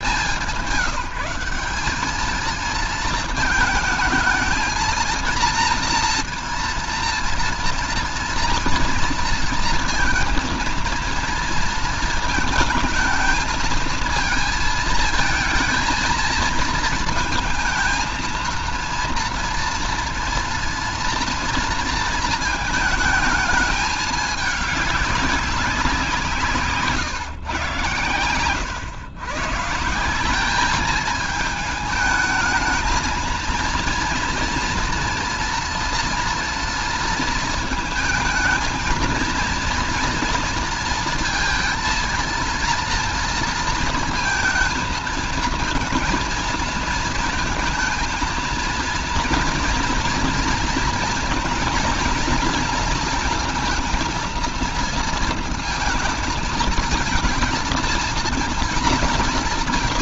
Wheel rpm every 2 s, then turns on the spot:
180, 220, 220, 230, 240, 230, 220, 220, 230, 230, 240, 220, 210, 170, 120, 200, 220, 230, 230, 220, 230, 230, 230, 230, 230, 230, 230, 230, 220, 230.
none